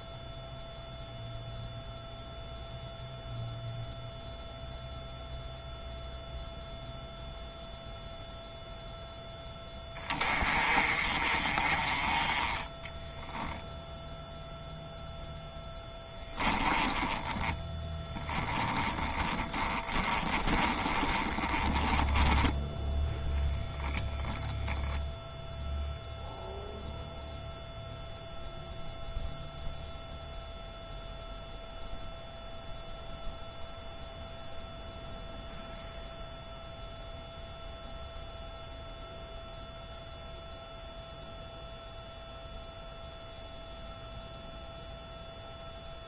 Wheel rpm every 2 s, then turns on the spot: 0, 0, 0, 0, 0, 30, 10, 0, 10, 20, 20, 10, 0, 0, 0, 0, 0, 0, 0, 0, 0, 0, 0.
12-14 16-22